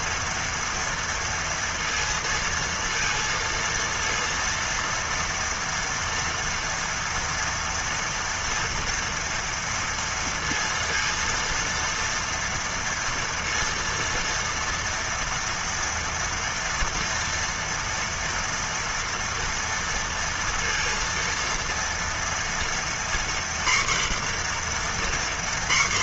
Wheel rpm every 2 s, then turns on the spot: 240, 230, 230, 230, 230, 230, 230, 230, 230, 230, 230, 230, 250.
none